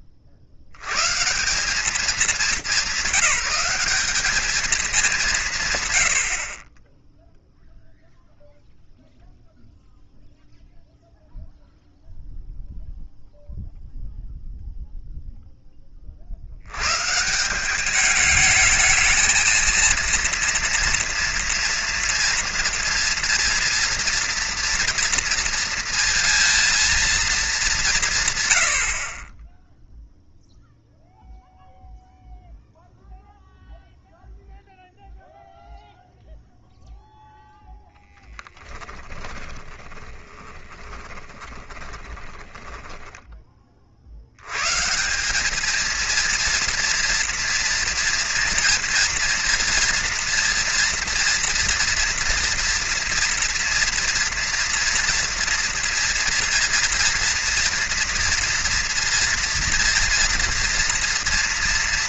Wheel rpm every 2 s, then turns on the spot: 40, 200, 200, 80, 0, 0, 0, 0, 30, 210, 230, 230, 230, 230, 170, 0, 0, 0, 0, 0, 10, 20, 70, 230, 230, 230, 230, 230, 230, 230, 230.
40-44